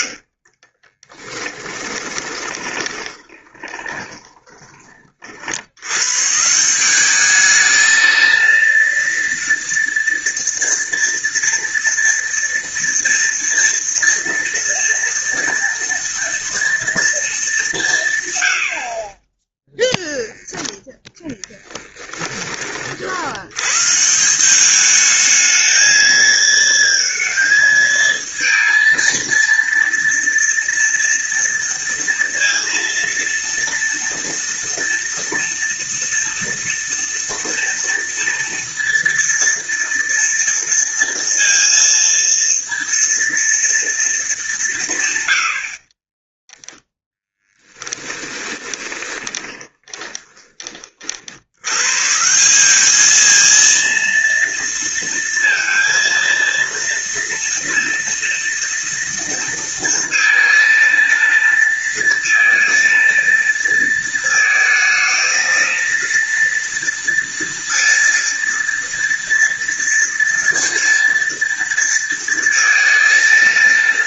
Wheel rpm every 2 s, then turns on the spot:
40, 20, 20, 170, 230, 230, 240, 230, 230, 80, 10, 40, 200, 230, 230, 230, 230, 230, 230, 230, 230, 230, 160, 10, 20, 30, 190, 230, 230, 230, 230, 230, 220, 230, 230, 230, 230.
0-4 48-50